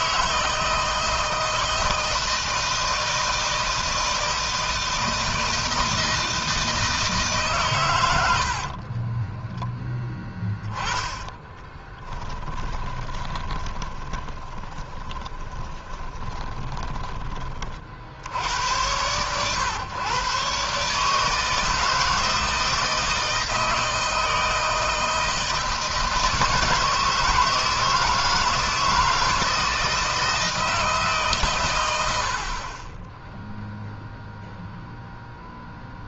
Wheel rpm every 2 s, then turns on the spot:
160, 160, 160, 160, 40, 10, 20, 20, 20, 100, 150, 160, 170, 160, 160, 150, 20, 0.
8-16